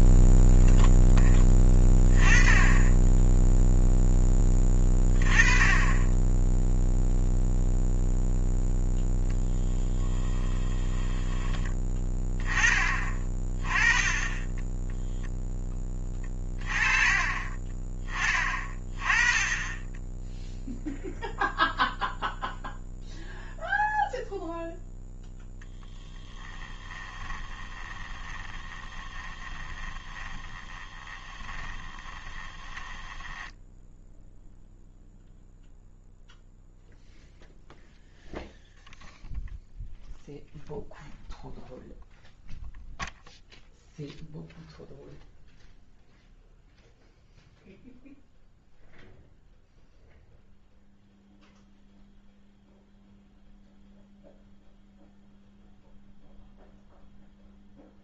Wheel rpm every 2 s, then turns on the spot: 0, 10, 20, 0, 0, 20, 20, 10, 30, 30, 0, 0, 0, 10, 20, 20, 20, 0, 0, 0, 0, 0, 0, 0, 0, 0, 0, 0, 0.
10-12 26-34